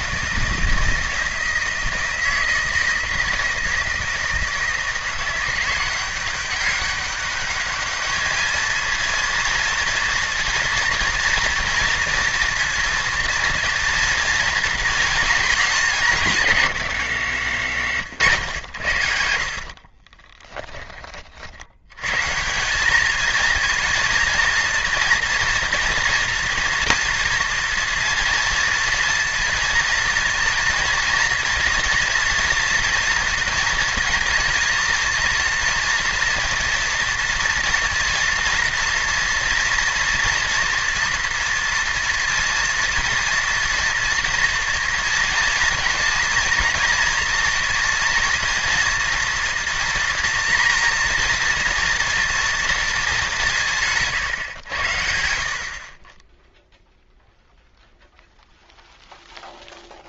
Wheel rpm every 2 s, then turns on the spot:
160, 160, 160, 190, 220, 230, 230, 230, 140, 100, 10, 180, 230, 230, 230, 230, 230, 230, 230, 230, 230, 230, 230, 230, 230, 230, 230, 110, 0, 0.
20-22